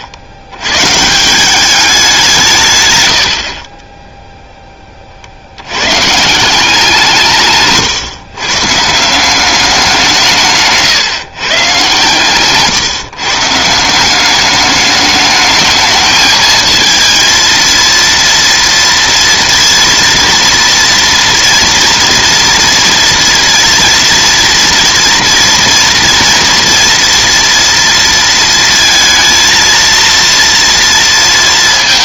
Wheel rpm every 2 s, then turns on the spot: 110, 140, 10, 170, 130, 140, 150, 210, 220, 240, 230, 230, 230, 240, 230, 230.
2-4 12-14